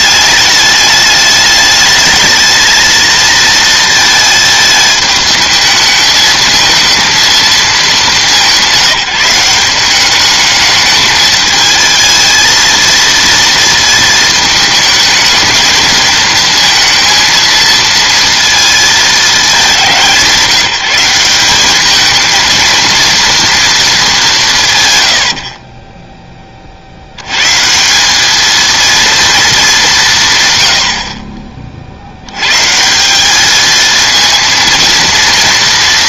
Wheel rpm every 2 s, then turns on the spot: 210, 230, 220, 220, 180, 210, 230, 220, 230, 220, 180, 230, 90, 80, 230, 60, 170, 230.
none